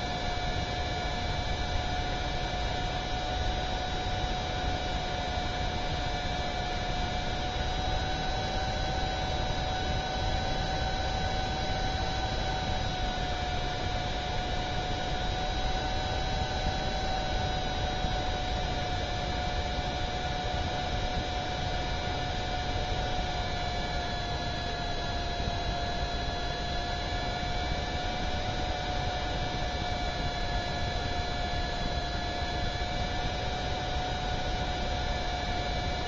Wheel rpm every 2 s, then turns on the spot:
0, 0, 0, 0, 0, 0, 0, 0, 0, 0, 0, 0, 0, 0, 0, 0, 0, 0.
none